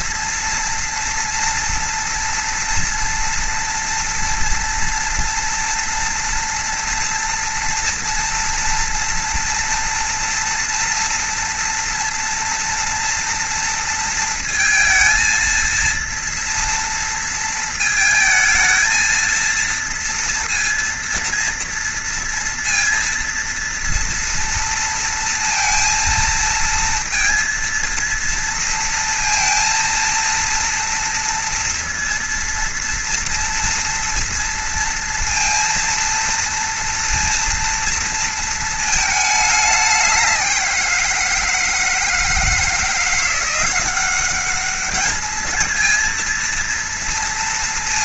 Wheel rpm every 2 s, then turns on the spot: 240, 230, 230, 240, 230, 230, 230, 230, 230, 220, 230, 230, 230, 230, 230, 230, 230, 230, 230, 230, 190, 160, 200, 230.
none